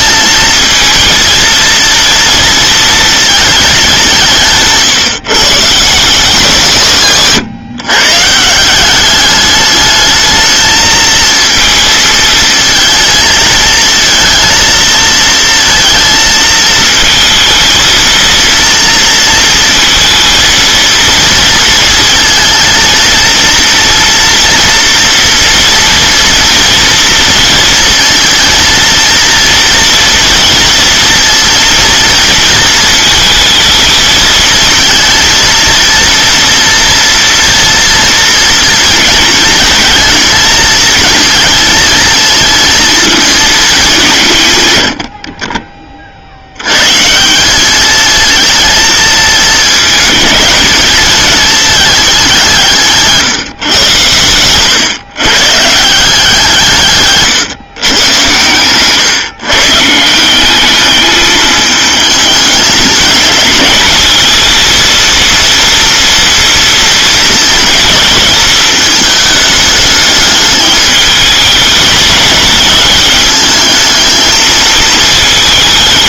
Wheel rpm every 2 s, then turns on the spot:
230, 230, 160, 160, 160, 220, 220, 230, 220, 230, 230, 230, 230, 230, 230, 230, 220, 230, 240, 240, 230, 230, 120, 70, 220, 220, 180, 110, 160, 120, 190, 210, 220, 230, 220, 210, 210, 220.
none